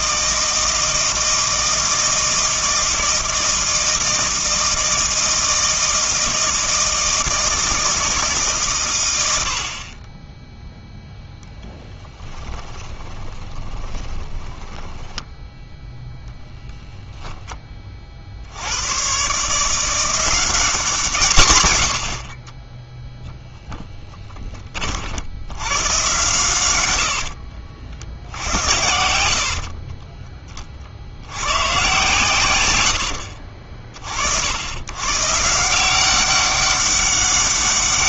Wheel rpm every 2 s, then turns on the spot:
160, 160, 160, 160, 120, 0, 20, 10, 0, 90, 180, 10, 40, 110, 70, 30, 90, 110, 200.
12-16 26-28